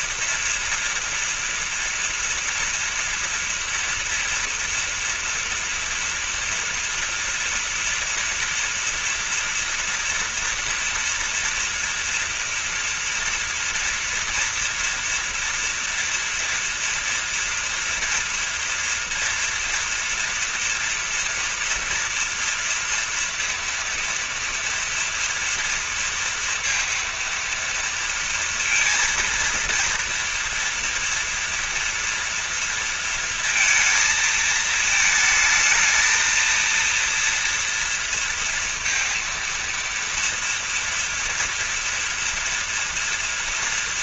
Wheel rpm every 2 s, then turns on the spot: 230, 230, 240, 230, 230, 230, 230, 230, 230, 230, 240, 230, 230, 230, 230, 230, 230, 220, 230, 230, 230, 230.
none